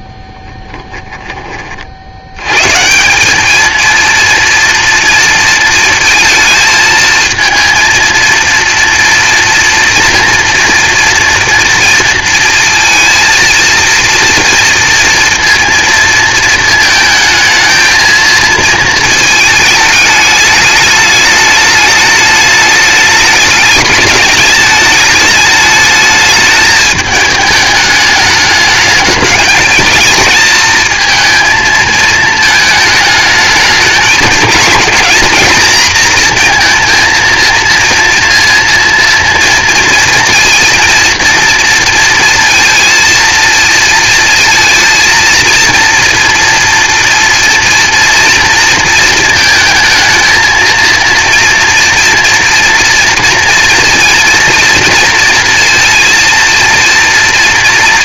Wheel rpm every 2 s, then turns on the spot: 20, 120, 230, 220, 230, 230, 230, 230, 220, 220, 210, 210, 210, 210, 210, 220, 220, 190, 230, 230, 230, 230, 230, 240, 230, 230, 230, 230, 230.
0-2